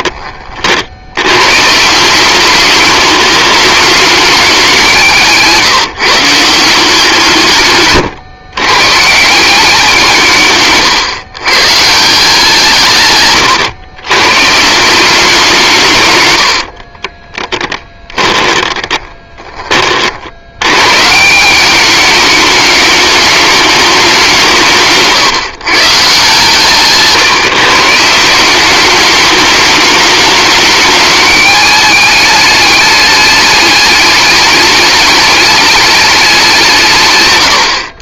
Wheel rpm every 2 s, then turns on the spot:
70, 200, 180, 170, 140, 140, 140, 160, 50, 20, 130, 210, 160, 140, 200, 210, 210, 210, 160.
10-12 16-20 24-28